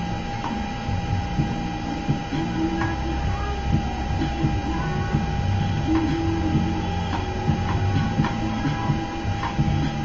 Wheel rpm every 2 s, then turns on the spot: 0, 0, 0, 0, 0.
none